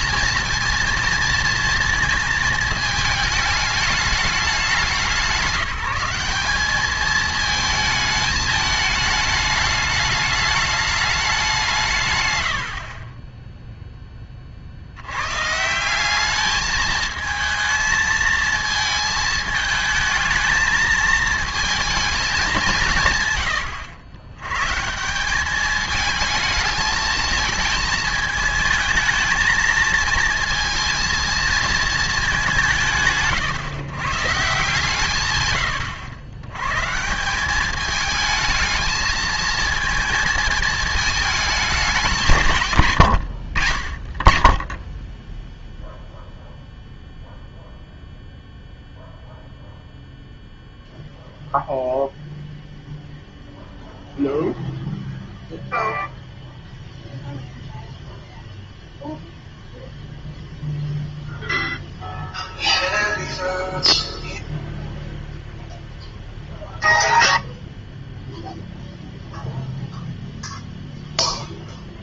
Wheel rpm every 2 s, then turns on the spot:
230, 220, 190, 200, 210, 210, 80, 40, 210, 220, 220, 190, 120, 220, 220, 220, 180, 150, 110, 220, 220, 150, 20, 0, 0, 0, 0, 0, 0, 0, 0, 0, 0, 0, 0, 0.
42-44